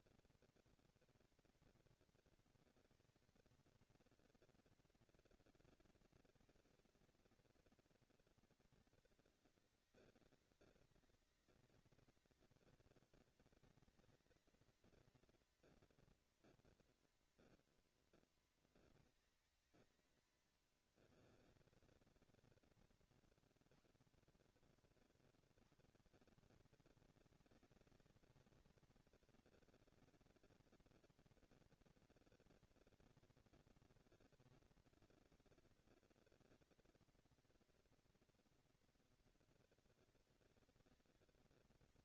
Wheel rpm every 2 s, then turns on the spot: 230, 230, 240, 230, 210, 190, 200, 220, 230, 230, 200, 180, 160, 190, 220, 230, 230, 220, 230, 230, 220.
none